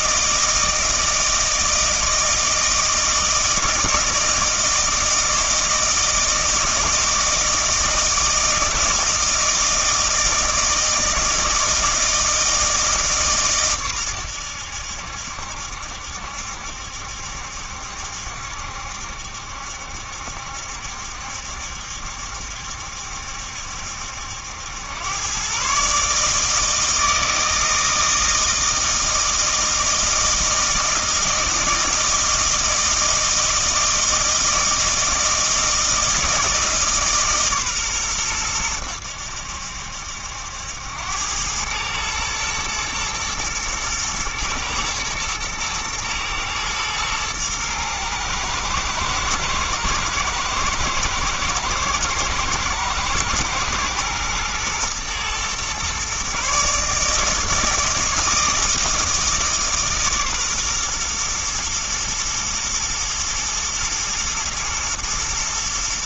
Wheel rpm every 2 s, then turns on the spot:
160, 160, 160, 160, 160, 160, 160, 90, 70, 70, 70, 70, 90, 160, 160, 160, 160, 160, 160, 100, 80, 110, 110, 110, 120, 120, 110, 120, 140, 160, 130, 110, 120.
none